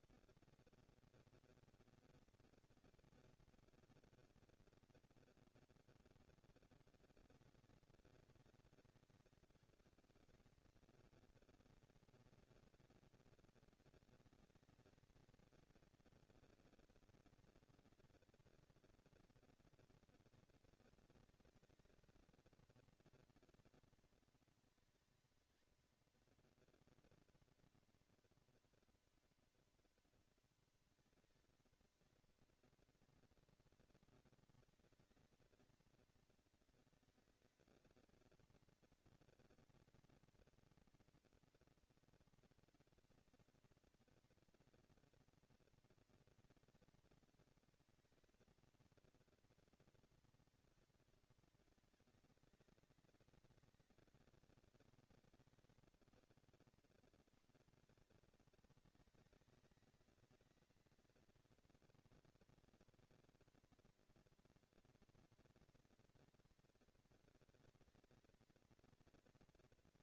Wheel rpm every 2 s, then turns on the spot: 230, 230, 230, 200, 190, 220, 230, 220, 230, 230, 220, 230, 230, 240, 230, 230, 230, 230, 230, 230, 230, 230, 230, 230, 230, 200, 200, 190, 130, 210, 230, 230, 240, 230, 230.
none